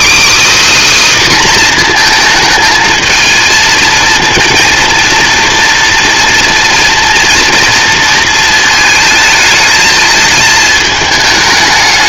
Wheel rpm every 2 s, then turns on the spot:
300, 220, 230, 230, 220, 220.
none